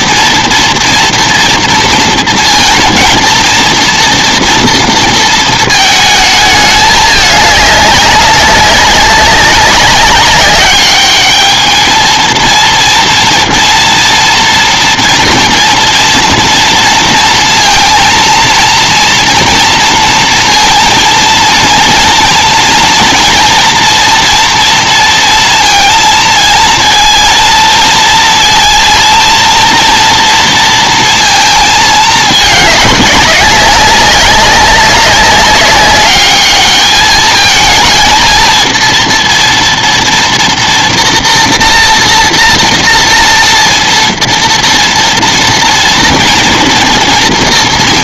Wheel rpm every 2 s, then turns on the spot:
240, 230, 230, 220, 200, 200, 230, 240, 230, 230, 230, 230, 230, 220, 230, 230, 220, 190, 200, 230, 230, 230, 230, 230.
none